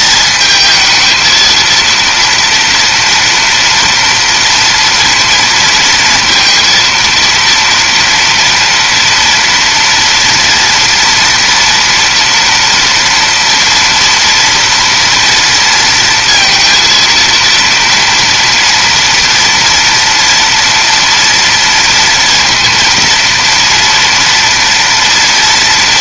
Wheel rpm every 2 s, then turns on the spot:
220, 230, 230, 230, 240, 230, 230, 230, 230, 230, 230, 230, 230.
none